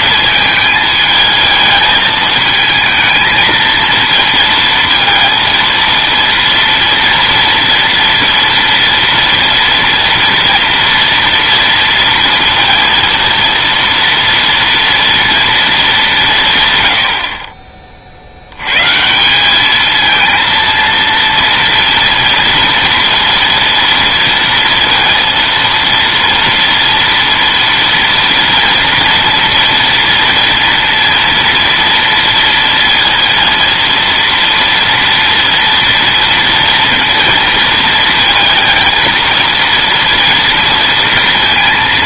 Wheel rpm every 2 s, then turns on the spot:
220, 220, 230, 230, 230, 230, 230, 230, 130, 110, 230, 230, 230, 230, 230, 230, 230, 230, 230, 230, 230.
none